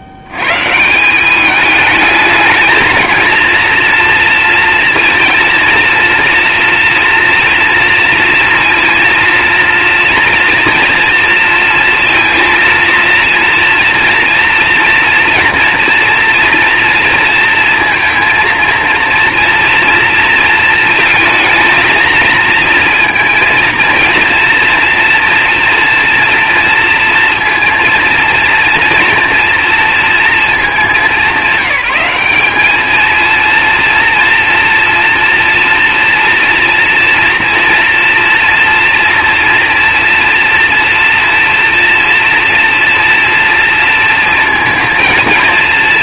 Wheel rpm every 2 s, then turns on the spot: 170, 230, 230, 230, 230, 230, 230, 230, 230, 230, 220, 230, 230, 230, 230, 200, 220, 230, 230, 230, 240, 230, 230.
none